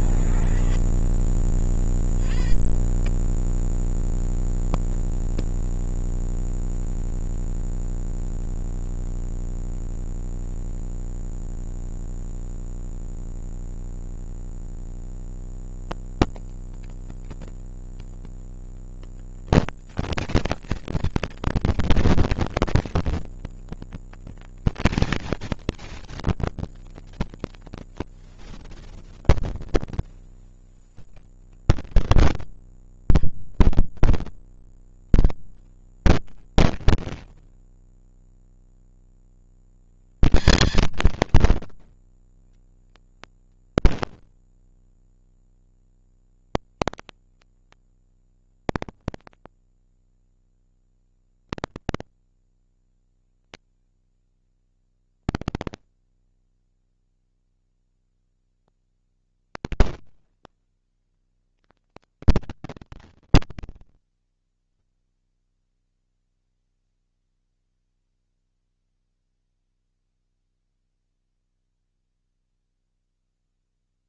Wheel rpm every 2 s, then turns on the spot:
0, 70, 20, 0, 0, 10, 140, 210, 230, 230, 230, 230, 230, 180, 40, 100, 50, 150, 140, 70, 180, 150, 20, 110, 30, 20, 100, 40, 10, 80, 210, 120, 0, 0, 0, 0, 0.
4-6 28-30 32-34 48-52 54-56